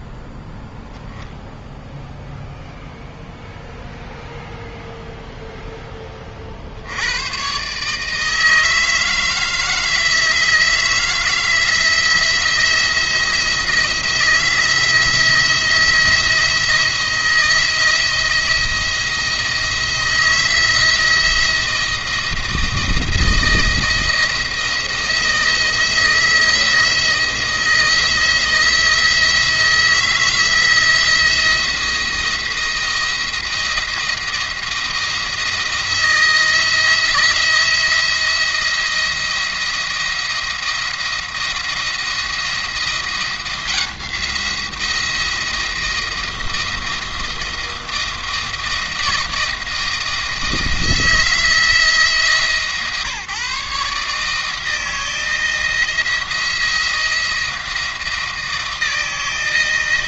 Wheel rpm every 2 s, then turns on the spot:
0, 0, 0, 80, 160, 160, 160, 170, 170, 170, 170, 170, 170, 170, 160, 160, 170, 170, 170, 170, 160, 170, 170, 160, 170, 170, 150, 160, 170, 160.
none